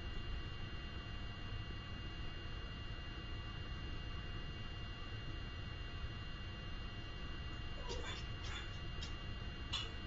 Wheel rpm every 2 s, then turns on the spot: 0, 0, 0, 0, 0.
none